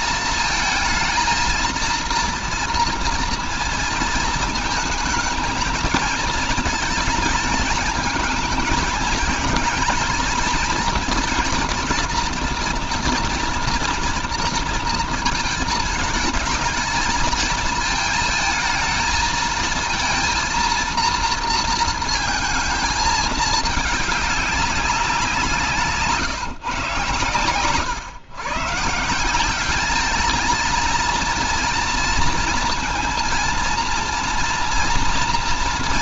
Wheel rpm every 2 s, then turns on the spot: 230, 230, 220, 230, 220, 230, 230, 230, 220, 230, 230, 220, 190, 120, 150, 220, 230, 240.
none